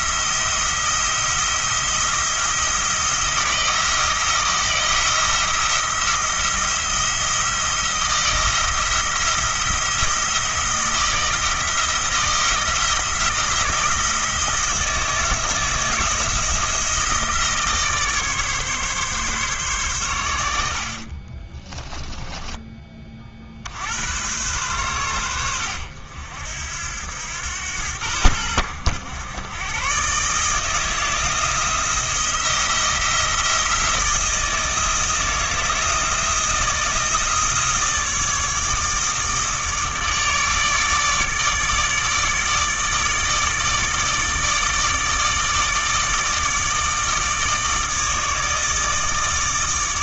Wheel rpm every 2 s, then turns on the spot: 170, 170, 170, 170, 170, 160, 160, 160, 160, 140, 50, 20, 100, 80, 100, 160, 170, 160, 160, 160, 150, 150, 160, 160, 150.
20-22